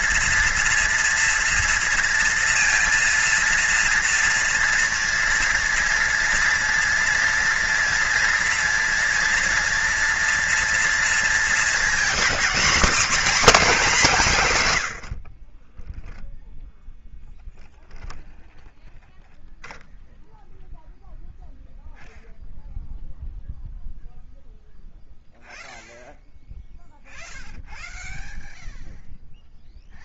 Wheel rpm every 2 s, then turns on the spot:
230, 230, 230, 230, 230, 230, 240, 160, 0, 0, 0, 0, 0, 0, 0.
none